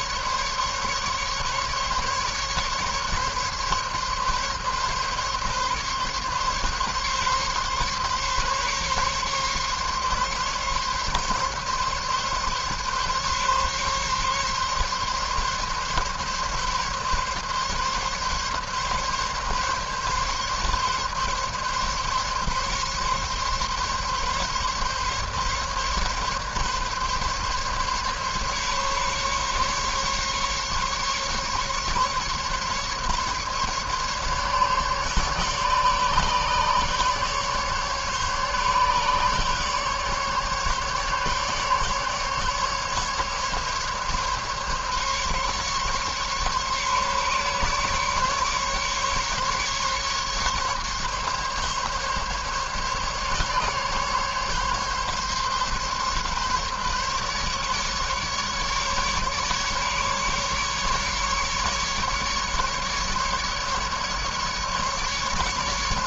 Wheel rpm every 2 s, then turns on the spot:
140, 140, 140, 140, 140, 140, 140, 140, 140, 140, 140, 140, 140, 140, 140, 140, 140, 140, 140, 140, 140, 140, 140, 150, 140, 140, 140, 140, 140, 150, 140, 150, 150.
none